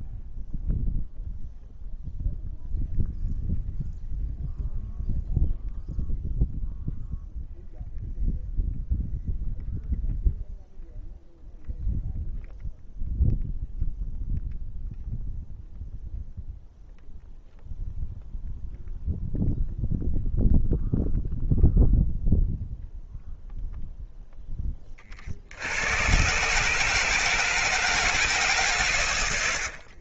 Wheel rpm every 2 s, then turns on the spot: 0, 0, 0, 0, 0, 0, 0, 0, 0, 0, 0, 0, 40, 150, 100.
none